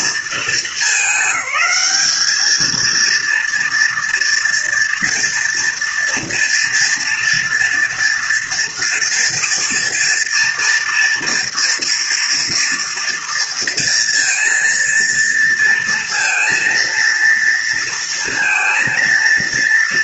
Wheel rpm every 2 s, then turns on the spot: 220, 220, 230, 230, 230, 230, 230, 230, 230, 230.
none